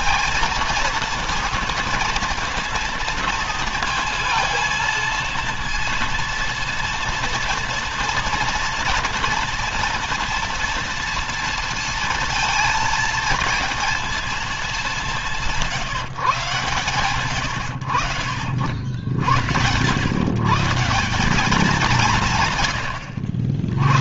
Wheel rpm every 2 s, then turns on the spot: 230, 230, 230, 230, 240, 230, 230, 210, 140, 60, 160, 120.
none